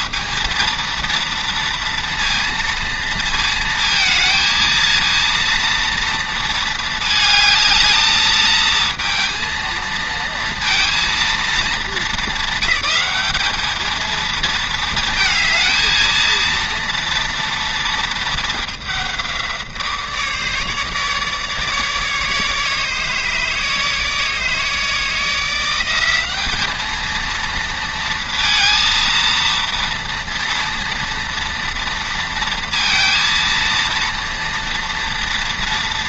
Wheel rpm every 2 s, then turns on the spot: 230, 230, 230, 220, 220, 230, 200, 220, 230, 210, 150, 150, 150, 210, 230, 230, 230, 230.
none